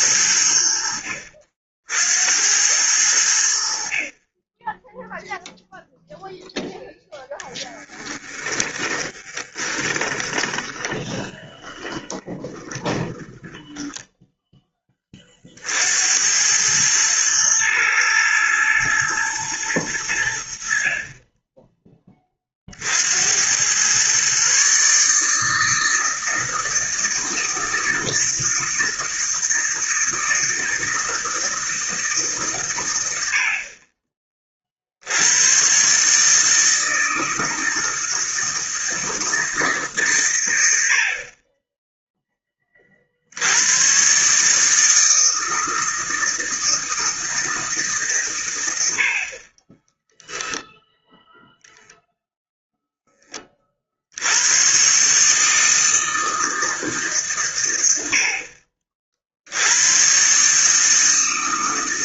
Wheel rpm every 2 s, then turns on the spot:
90, 80, 0, 0, 20, 20, 10, 30, 110, 110, 30, 70, 150, 160, 160, 160, 80, 90, 160, 160, 40, 50, 160, 160, 60, 0, 0, 120, 160, 50, 150.
8-14